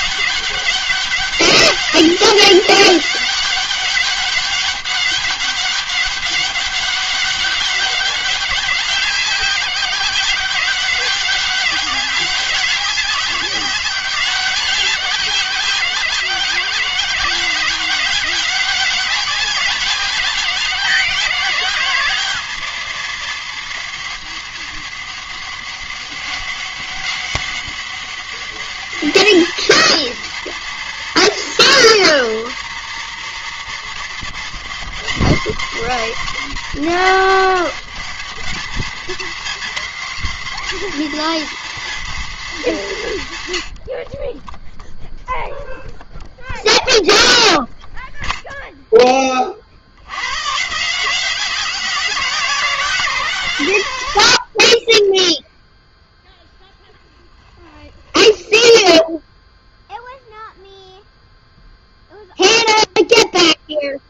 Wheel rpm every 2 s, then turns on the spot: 200, 190, 200, 200, 190, 190, 200, 190, 180, 190, 190, 190, 200, 200, 200, 200, 200, 200, 230, 220, 230, 210, 20, 0, 0, 120, 170, 60, 0, 0, 0, 0.
none